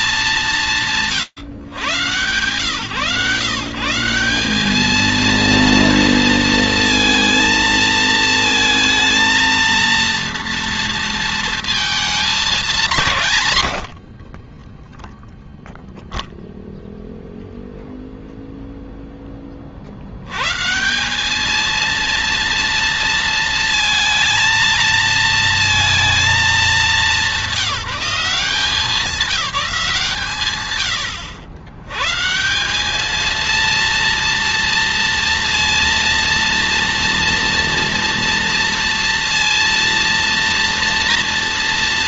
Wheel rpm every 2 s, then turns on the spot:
80, 150, 230, 230, 230, 220, 100, 0, 0, 70, 230, 230, 230, 200, 170, 130, 230, 230, 230, 230, 230.
12-14